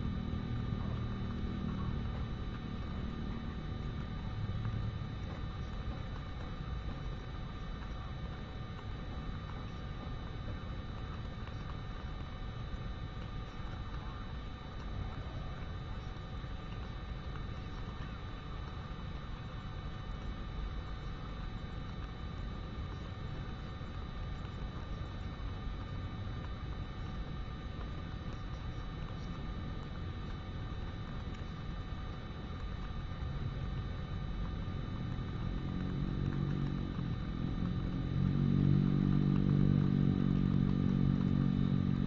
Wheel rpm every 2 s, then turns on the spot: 0, 0, 0, 0, 0, 0, 0, 0, 0, 0, 0, 0, 0, 0, 0, 0, 0, 0, 0, 0, 0.
none